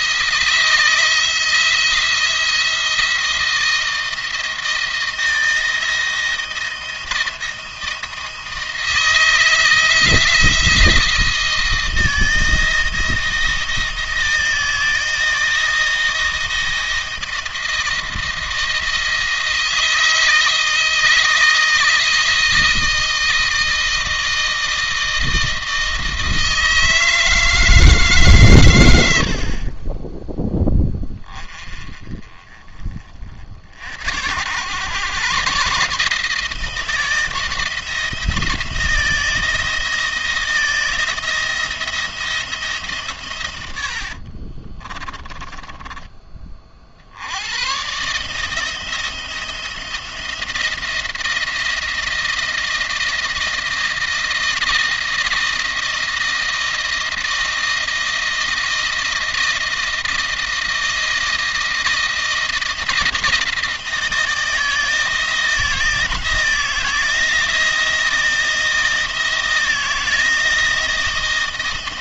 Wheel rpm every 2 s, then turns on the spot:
170, 170, 160, 160, 160, 170, 170, 160, 170, 160, 160, 160, 160, 160, 120, 10, 20, 100, 160, 170, 160, 150, 30, 40, 160, 170, 160, 160, 160, 170, 160, 160, 160, 160, 170, 170.
44-46